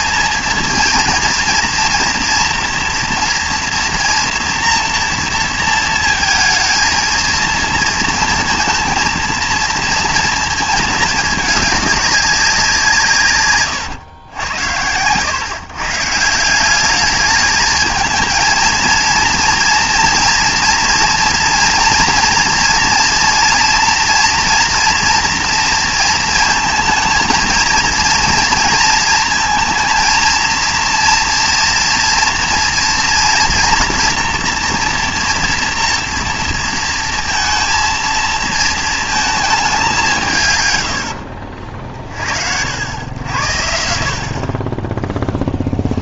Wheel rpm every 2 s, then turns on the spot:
230, 230, 230, 220, 230, 230, 190, 90, 180, 220, 230, 240, 230, 230, 230, 230, 230, 230, 230, 220, 120, 70, 30.
none